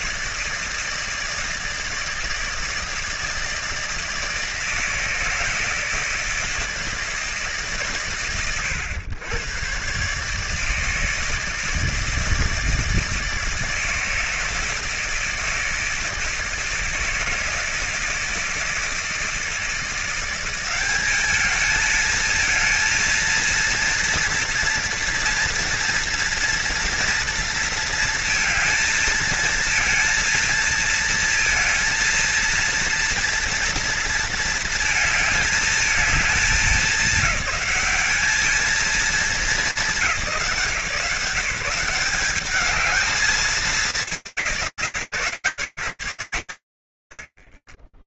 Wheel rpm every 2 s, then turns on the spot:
160, 160, 160, 160, 110, 150, 160, 160, 160, 160, 200, 230, 240, 230, 230, 220, 230, 220, 200, 210, 160, 220, 130, 140.
none